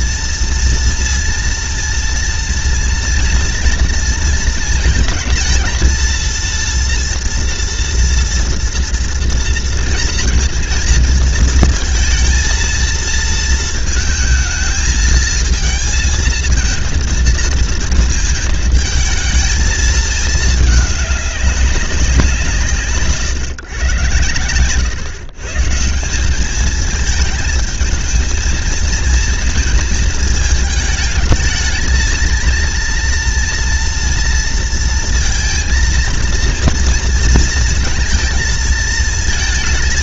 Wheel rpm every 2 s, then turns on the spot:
230, 230, 230, 230, 230, 230, 230, 220, 230, 220, 220, 180, 120, 180, 220, 220, 230, 230, 230, 230.
none